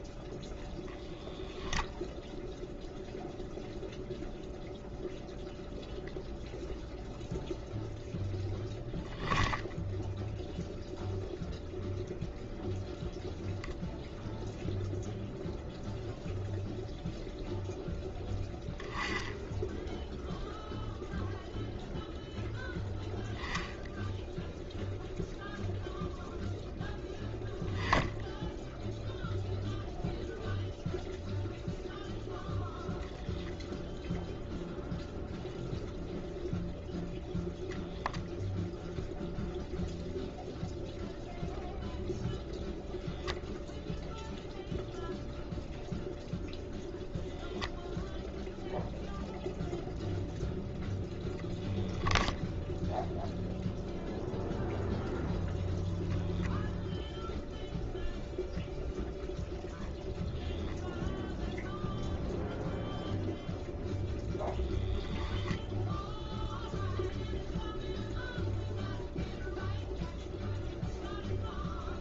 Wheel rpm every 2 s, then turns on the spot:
0, 0, 0, 0, 10, 0, 0, 0, 0, 10, 0, 0, 0, 0, 0, 0, 0, 0, 0, 0, 0, 0, 0, 0, 0, 0, 0, 0, 0, 0, 0, 0, 0, 0, 0, 0.
none